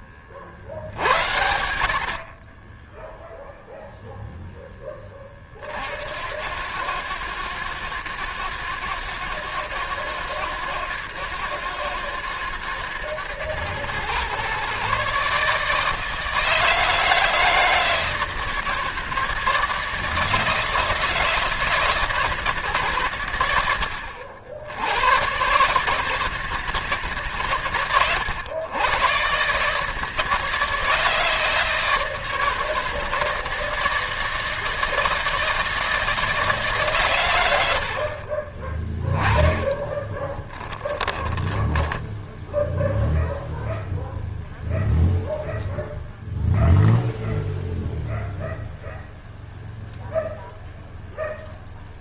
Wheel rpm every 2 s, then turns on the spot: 60, 30, 10, 100, 110, 120, 110, 130, 160, 160, 160, 150, 90, 150, 100, 160, 160, 160, 150, 30, 20, 0, 0, 0, 0, 0.
0-4 40-42